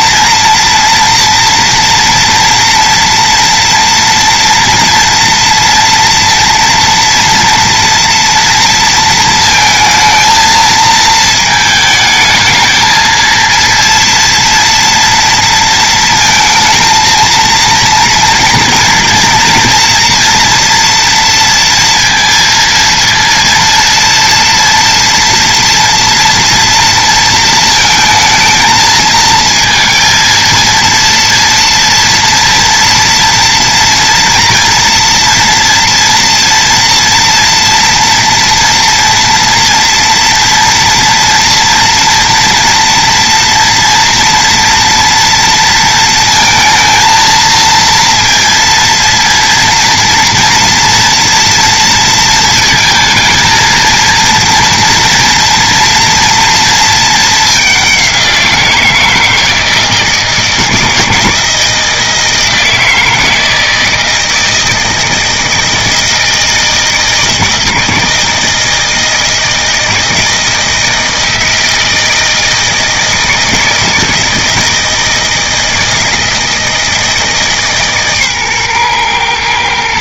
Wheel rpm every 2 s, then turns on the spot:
230, 230, 230, 230, 230, 220, 220, 230, 230, 230, 240, 230, 240, 230, 220, 230, 240, 230, 230, 230, 230, 240, 240, 230, 230, 230, 230, 230, 230, 170, 160, 160, 160, 160, 160, 160, 160, 160, 160, 130.
none